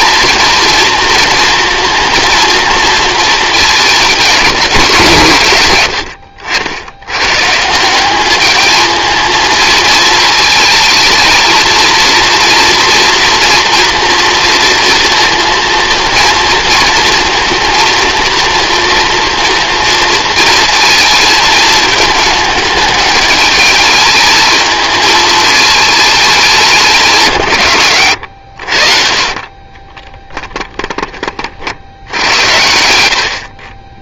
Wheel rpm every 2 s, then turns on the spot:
230, 230, 190, 90, 210, 220, 230, 230, 230, 230, 230, 210, 220, 180, 50, 10, 80.
none